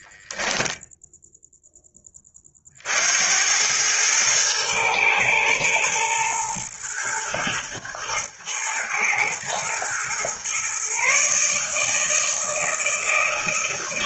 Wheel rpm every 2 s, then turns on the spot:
0, 60, 120, 120, 110, 130, 160.
none